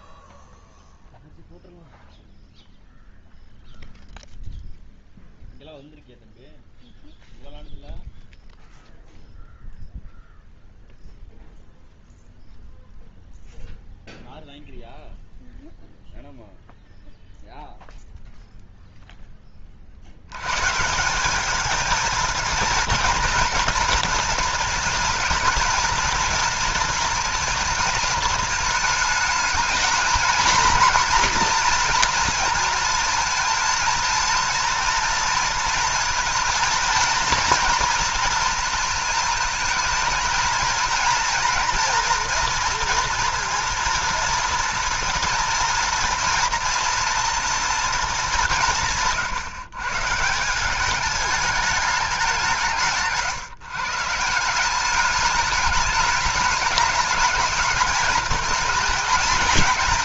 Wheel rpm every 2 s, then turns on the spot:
0, 0, 0, 0, 0, 0, 0, 0, 0, 0, 130, 230, 220, 230, 220, 230, 230, 230, 230, 230, 230, 230, 230, 230, 180, 190, 170, 180, 210, 220.
none